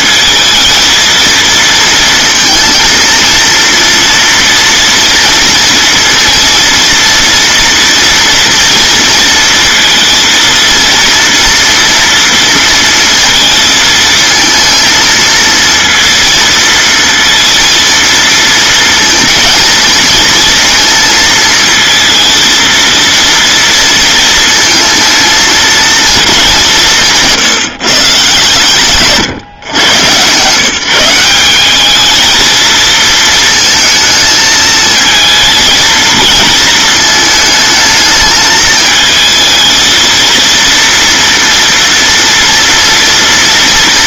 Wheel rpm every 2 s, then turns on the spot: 220, 230, 230, 230, 230, 230, 230, 220, 230, 230, 230, 230, 230, 190, 140, 160, 230, 220, 220, 220, 230, 230.
none